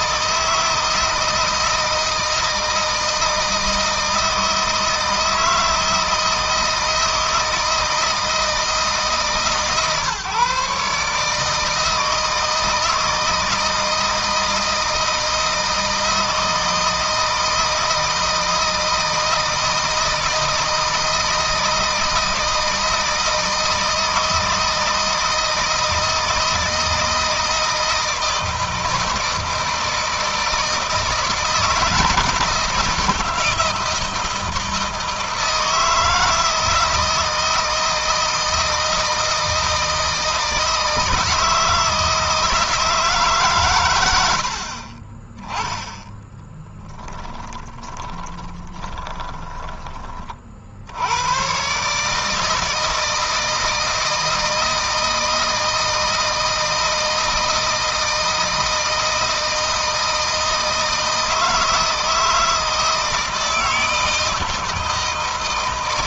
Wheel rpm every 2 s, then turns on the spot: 160, 160, 160, 160, 150, 150, 160, 160, 160, 160, 160, 160, 160, 160, 160, 160, 160, 160, 160, 160, 160, 150, 30, 10, 10, 70, 160, 160, 160, 160, 160, 160, 160.
46-50